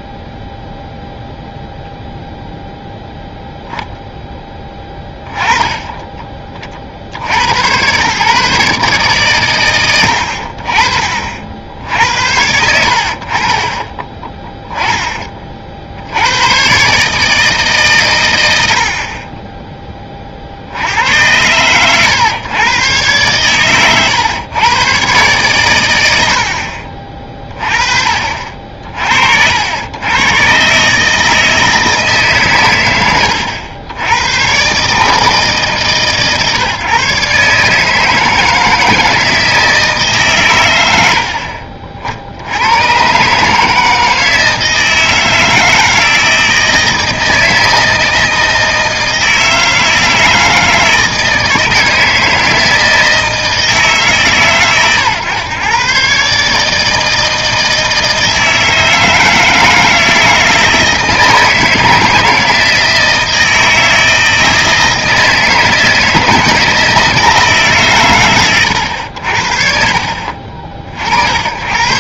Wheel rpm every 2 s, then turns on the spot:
0, 0, 10, 30, 140, 50, 70, 10, 120, 90, 70, 120, 120, 60, 60, 130, 120, 130, 140, 160, 120, 100, 160, 160, 160, 160, 160, 130, 150, 160, 160, 160, 160, 160, 100, 50.
none